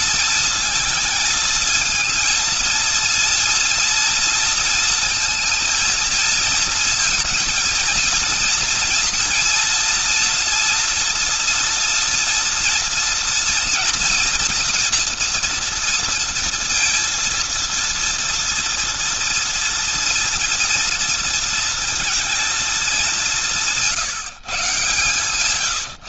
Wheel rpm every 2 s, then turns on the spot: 220, 230, 230, 230, 230, 240, 230, 230, 230, 230, 230, 220, 160.
none